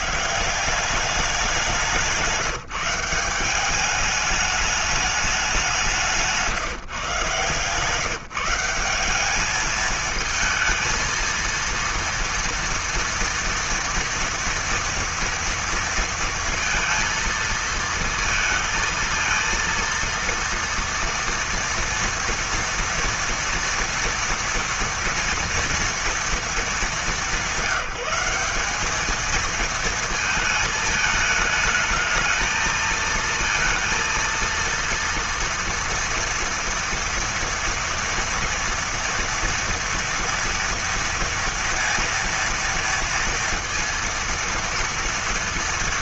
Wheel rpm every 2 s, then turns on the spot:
190, 180, 210, 160, 180, 220, 230, 240, 230, 230, 230, 230, 230, 210, 200, 220, 220, 230, 230, 230, 230, 230, 230.
none